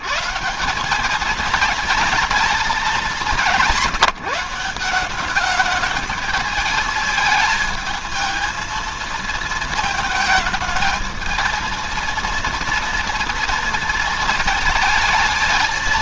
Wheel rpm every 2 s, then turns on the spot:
150, 220, 170, 210, 230, 220, 230, 220.
none